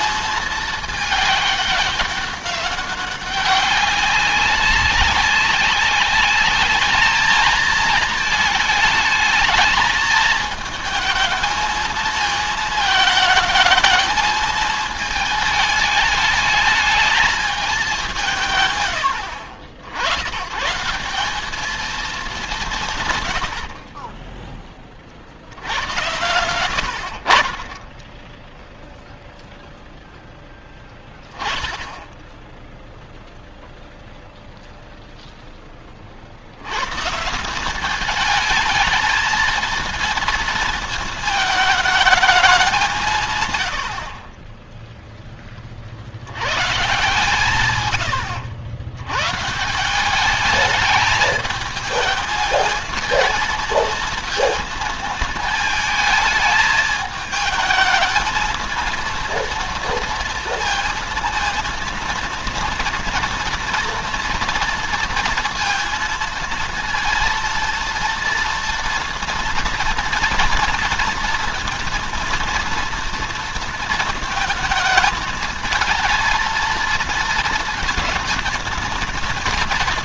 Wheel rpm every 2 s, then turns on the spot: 220, 190, 190, 210, 220, 220, 220, 220, 220, 140, 130, 180, 20, 80, 10, 0, 0, 0, 80, 220, 230, 200, 20, 120, 100, 210, 220, 230, 220, 220, 230, 230, 230, 230, 230, 230, 230, 220, 230, 230.
none